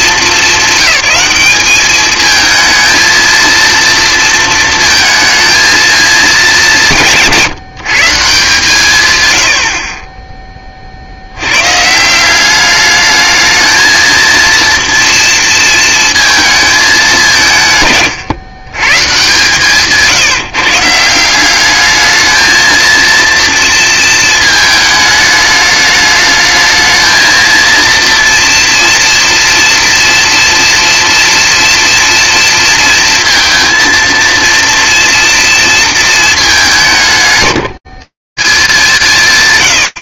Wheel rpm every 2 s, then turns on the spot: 190, 230, 230, 200, 150, 20, 200, 230, 220, 130, 160, 230, 220, 220, 230, 240, 230, 230, 180, 180.
none